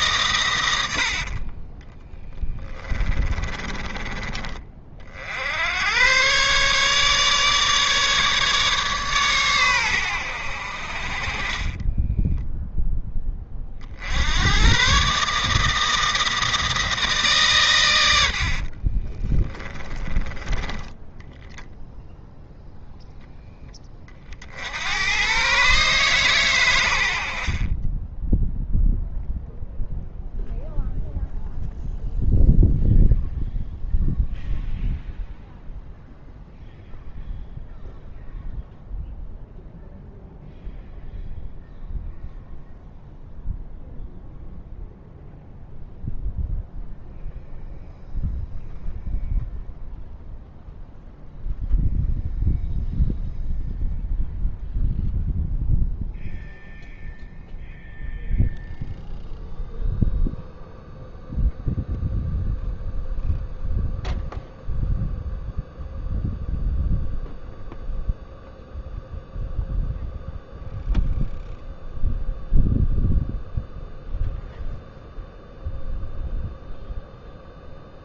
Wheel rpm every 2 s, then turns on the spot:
90, 10, 40, 140, 150, 70, 0, 120, 160, 30, 10, 0, 80, 100, 0, 0, 0, 0, 0, 0, 0, 0, 0, 0, 0, 0, 0, 0, 0, 0, 0, 0, 0, 0, 0, 0, 0, 0, 0.
0-4 18-20